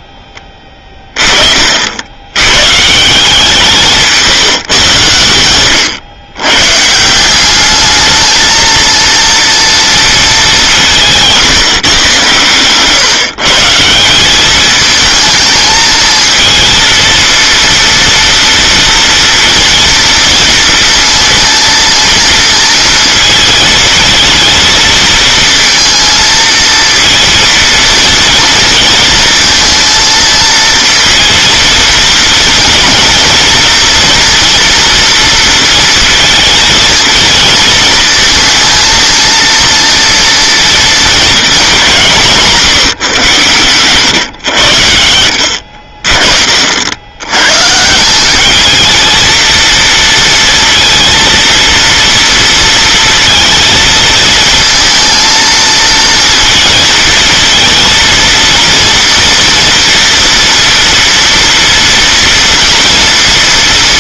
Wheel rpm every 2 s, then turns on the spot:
20, 140, 140, 130, 230, 190, 130, 220, 230, 240, 230, 220, 230, 230, 230, 230, 230, 230, 220, 220, 230, 160, 90, 70, 220, 230, 230, 230, 230, 230, 230, 230.
12-14